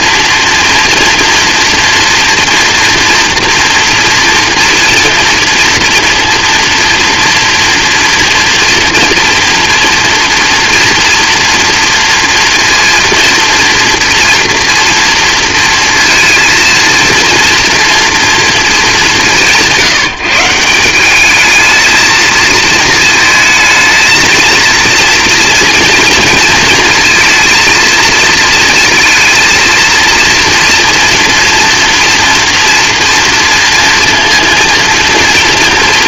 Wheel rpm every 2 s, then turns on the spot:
240, 230, 230, 230, 230, 230, 230, 230, 230, 210, 180, 220, 230, 230, 220, 230, 230, 230.
none